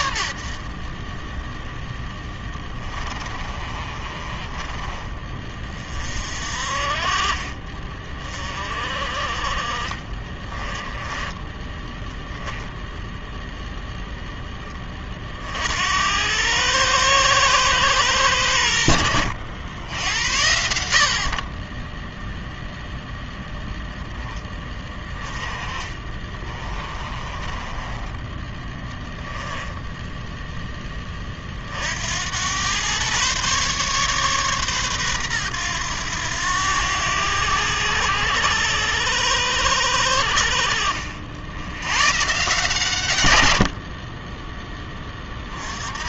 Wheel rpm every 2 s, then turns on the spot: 40, 30, 30, 30, 30, 20, 0, 20, 110, 100, 70, 0, 20, 30, 10, 10, 100, 130, 90, 90, 70, 140, 10.
2-4 10-12 26-30 40-42